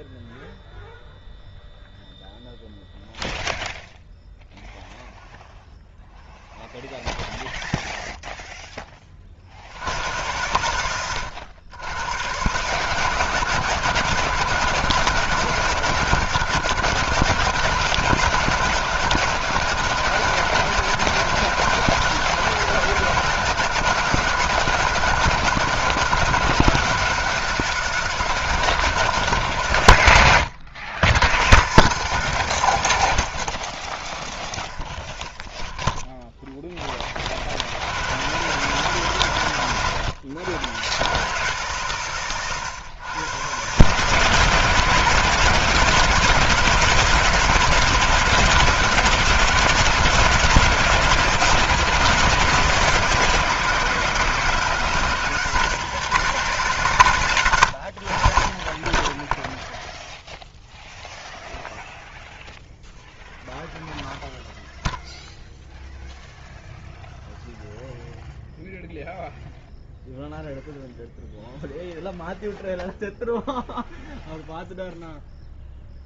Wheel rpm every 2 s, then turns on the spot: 0, 0, 0, 0, 0, 100, 130, 160, 140, 140, 150, 160, 160, 150, 150, 100, 140, 0, 10, 120, 90, 120, 140, 150, 150, 140, 120, 120, 140, 30, 0, 0, 0, 0, 0, 0, 0, 0.
none